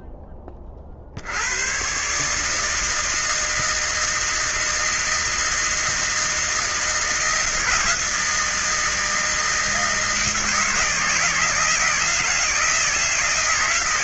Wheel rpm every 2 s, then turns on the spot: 20, 150, 160, 160, 160, 160, 170.
none